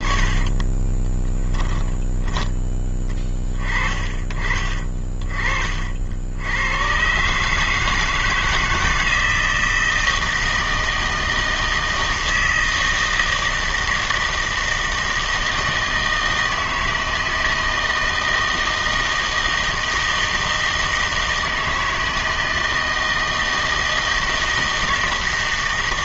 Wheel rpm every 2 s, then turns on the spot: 20, 10, 20, 100, 160, 160, 160, 160, 160, 160, 160, 160, 160.
0-2